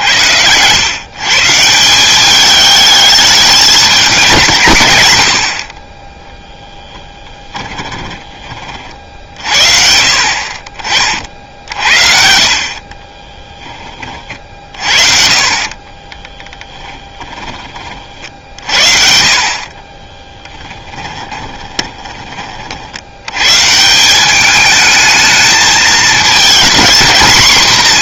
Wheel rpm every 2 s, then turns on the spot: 130, 210, 90, 10, 50, 40, 40, 50, 10, 50, 10, 80, 220, 230.
6-8 12-18 20-22